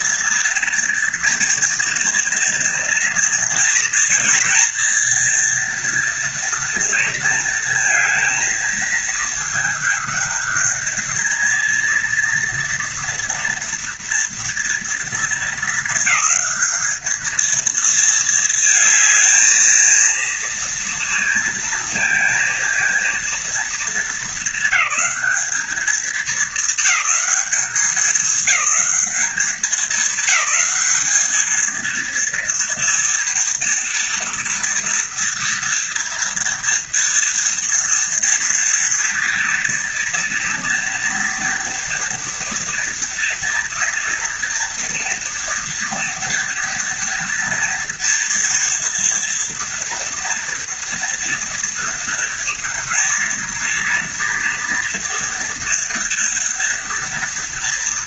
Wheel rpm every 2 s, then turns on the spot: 230, 230, 230, 230, 220, 220, 230, 230, 220, 220, 230, 230, 200, 220, 210, 200, 230, 230, 230, 230, 230, 230, 230, 230, 230, 230, 230, 230, 230.
none